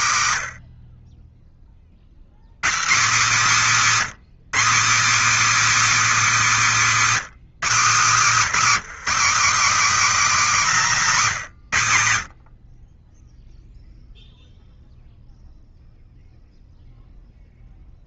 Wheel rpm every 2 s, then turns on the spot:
90, 160, 250, 260, 240, 230, 30, 0, 0.
none